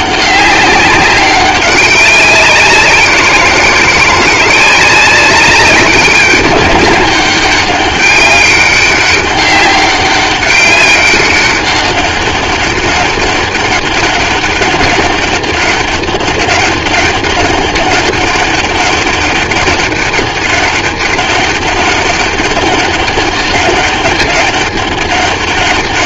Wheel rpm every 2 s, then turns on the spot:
200, 190, 180, 200, 200, 200, 200, 200, 200, 200, 200, 200, 200.
none